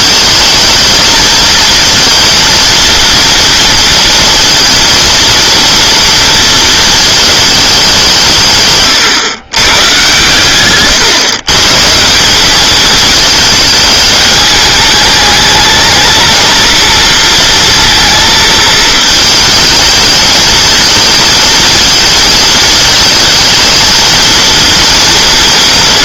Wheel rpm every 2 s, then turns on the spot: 220, 230, 230, 230, 140, 120, 220, 210, 230, 220, 220, 220, 230.
none